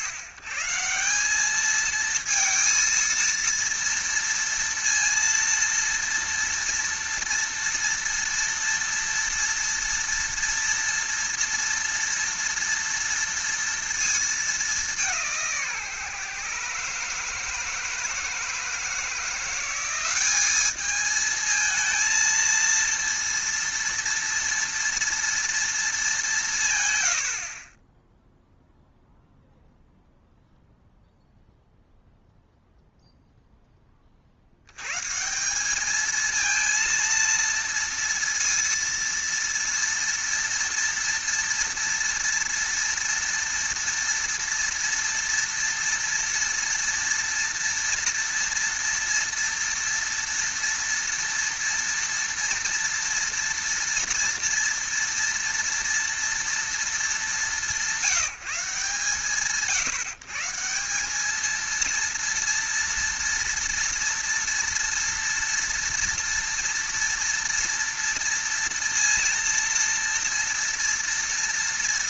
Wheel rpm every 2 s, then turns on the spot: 130, 230, 230, 230, 230, 230, 230, 210, 150, 160, 200, 230, 230, 150, 0, 0, 0, 80, 230, 230, 230, 230, 230, 230, 230, 230, 230, 230, 230, 140, 160, 230, 230, 230, 230, 230.
none